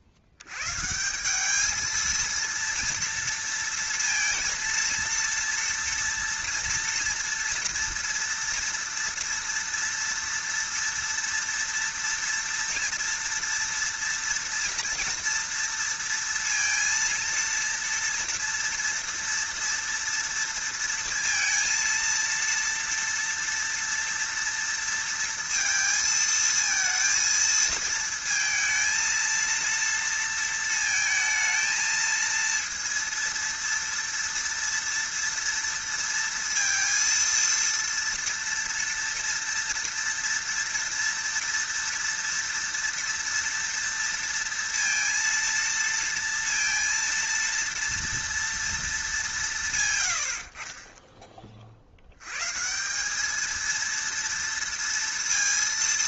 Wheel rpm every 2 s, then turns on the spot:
80, 230, 230, 240, 230, 230, 240, 230, 230, 230, 230, 230, 230, 230, 230, 230, 230, 230, 230, 230, 230, 230, 230, 230, 230, 40, 150, 230.
none